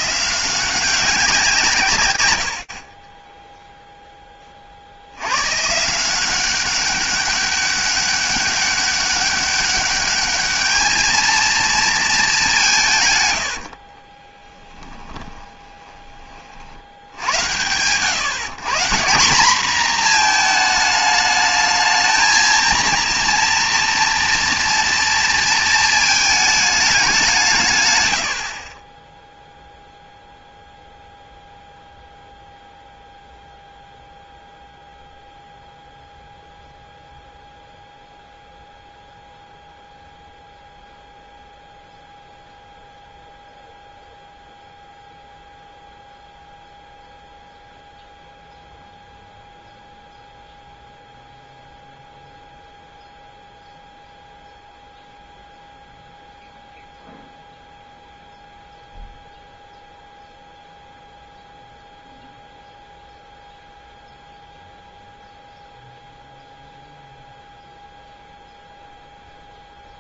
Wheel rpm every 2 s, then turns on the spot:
180, 90, 40, 190, 200, 210, 170, 10, 70, 170, 220, 230, 230, 210, 20, 0, 0, 0, 0, 0, 0, 0, 0, 0, 0, 0, 0, 0, 0, 0, 0, 0, 0, 0, 0.
14-16